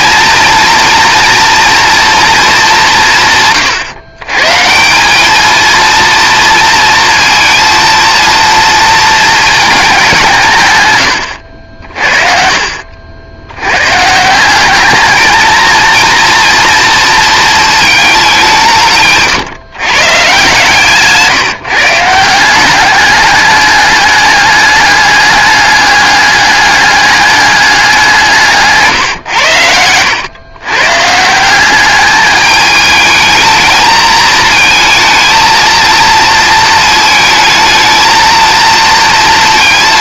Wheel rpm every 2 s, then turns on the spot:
230, 200, 170, 230, 230, 130, 60, 200, 230, 160, 150, 190, 210, 210, 150, 120, 210, 230, 220, 230.
none